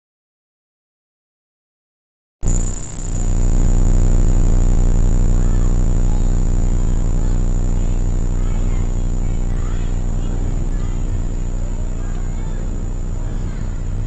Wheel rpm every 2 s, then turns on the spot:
0, 0, 0, 0, 0, 0, 0.
none